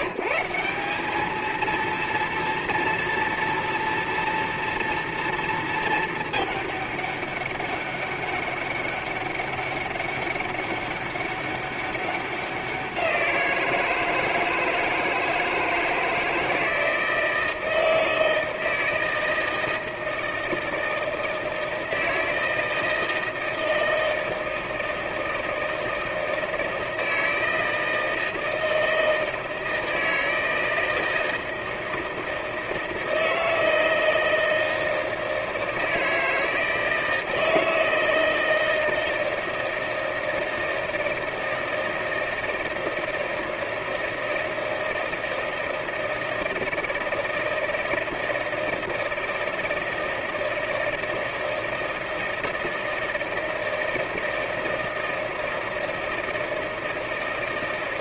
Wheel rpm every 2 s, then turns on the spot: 180, 230, 230, 210, 200, 200, 190, 160, 160, 160, 160, 160, 160, 160, 160, 160, 160, 160, 160, 160, 160, 160, 160, 160, 160, 160, 160, 160, 160.
none